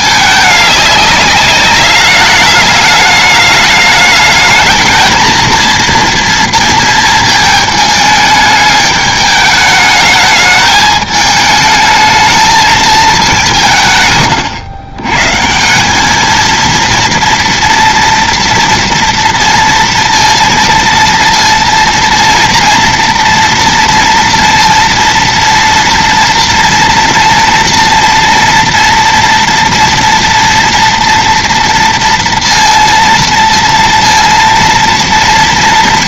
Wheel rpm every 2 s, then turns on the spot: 200, 210, 220, 230, 210, 210, 220, 110, 230, 230, 230, 230, 230, 230, 230, 230, 230, 230.
none